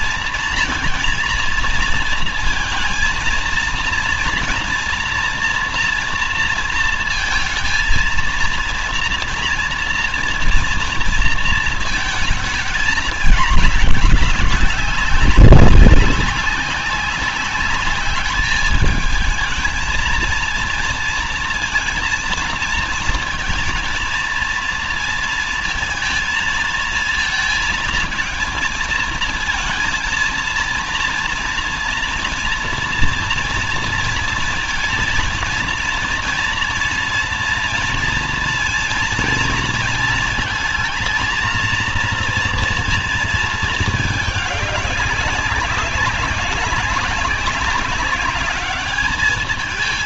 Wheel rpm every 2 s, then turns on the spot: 230, 230, 240, 230, 230, 230, 220, 190, 200, 210, 230, 220, 230, 230, 220, 230, 230, 230, 230, 230, 230, 230, 210, 190, 200.
none